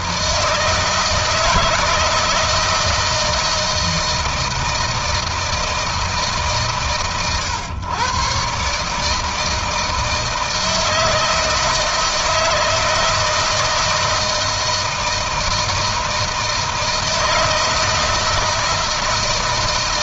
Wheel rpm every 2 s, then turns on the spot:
160, 160, 160, 130, 140, 160, 160, 160, 160, 160.
none